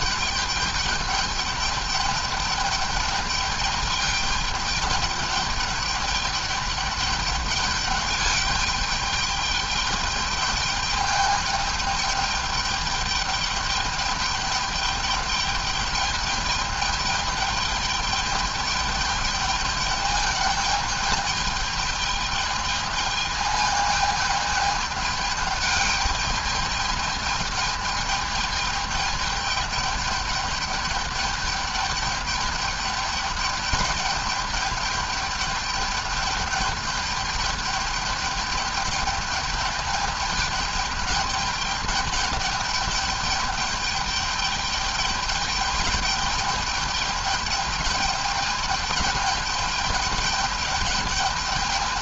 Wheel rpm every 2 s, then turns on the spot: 210, 210, 210, 210, 210, 210, 210, 210, 210, 210, 210, 210, 220, 210, 210, 210, 210, 210, 210, 200, 210, 200, 210, 210, 210, 210.
none